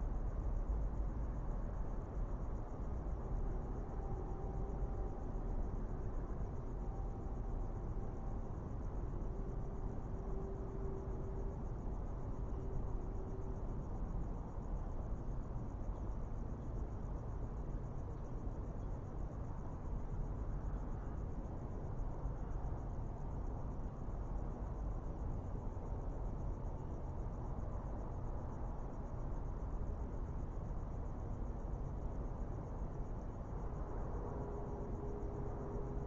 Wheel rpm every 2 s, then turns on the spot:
0, 0, 0, 0, 0, 0, 0, 0, 0, 0, 0, 0, 0, 0, 0, 0, 0, 0.
none